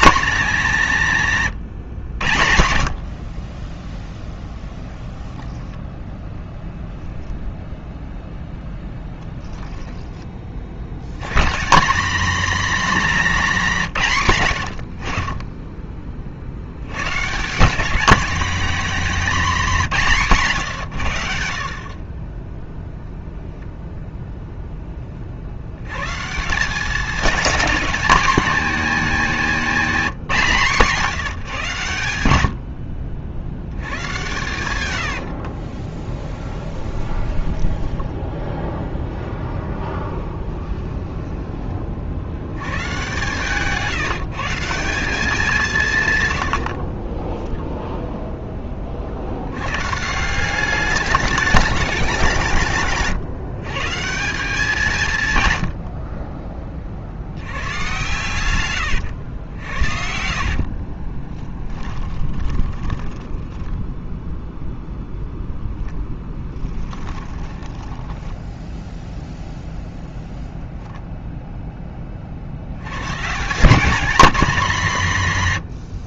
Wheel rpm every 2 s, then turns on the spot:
180, 70, 10, 0, 10, 60, 250, 70, 100, 230, 150, 0, 10, 190, 220, 170, 60, 100, 10, 0, 10, 100, 170, 70, 20, 190, 160, 180, 30, 110, 50, 20, 0, 10, 0, 0, 90, 200.
36-38 40-42 46-48 60-64 66-68